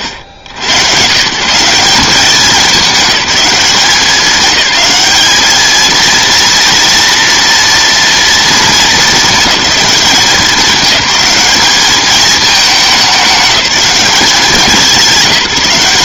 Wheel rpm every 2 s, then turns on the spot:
90, 210, 210, 230, 220, 200, 210, 180.
none